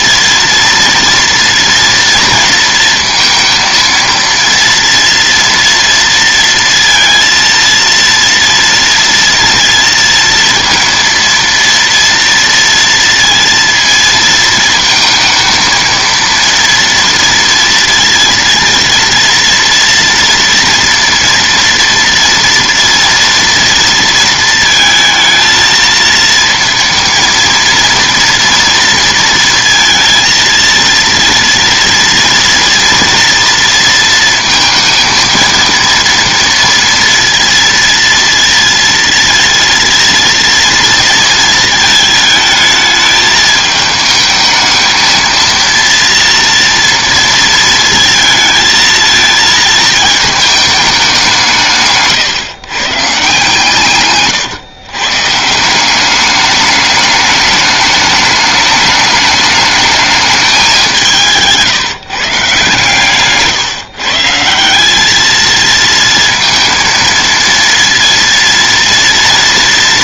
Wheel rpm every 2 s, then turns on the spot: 230, 230, 230, 230, 230, 230, 230, 220, 230, 230, 230, 240, 230, 230, 230, 230, 230, 230, 230, 230, 230, 220, 220, 230, 220, 210, 130, 130, 210, 210, 200, 150, 180, 230, 230.
none